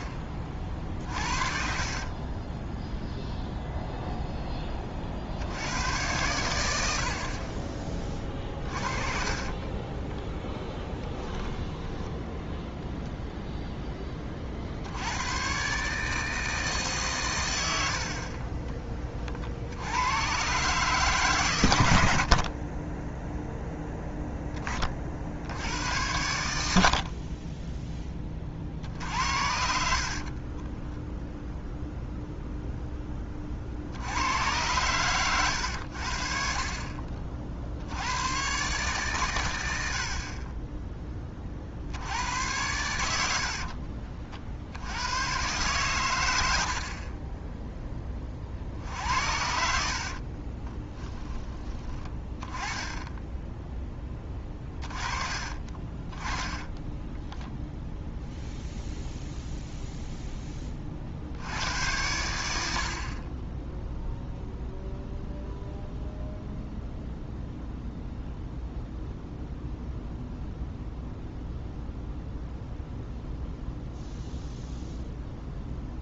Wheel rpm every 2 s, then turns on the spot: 40, 10, 20, 80, 30, 10, 0, 60, 160, 40, 130, 40, 20, 70, 50, 20, 0, 100, 40, 120, 20, 90, 60, 70, 60, 20, 10, 20, 10, 0, 20, 70, 0, 0, 0, 0, 0, 0.
0-2 8-10 22-24 30-32 46-48 50-52 56-58